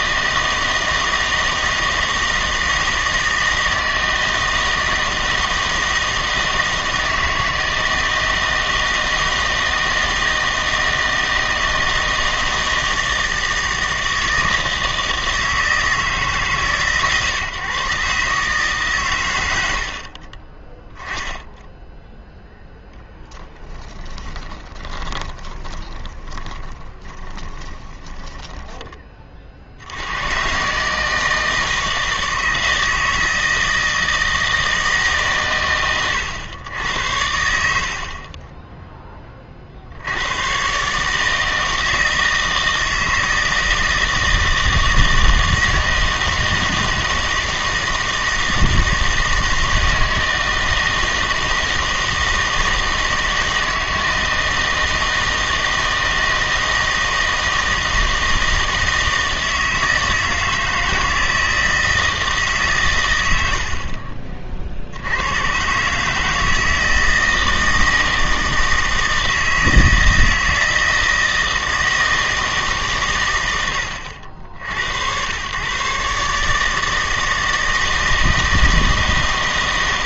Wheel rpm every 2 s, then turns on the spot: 160, 160, 160, 160, 160, 160, 160, 160, 140, 140, 10, 10, 30, 20, 10, 140, 160, 150, 90, 10, 140, 160, 160, 160, 160, 160, 160, 160, 160, 160, 160, 130, 70, 160, 160, 170, 140, 90, 160, 160.
24-28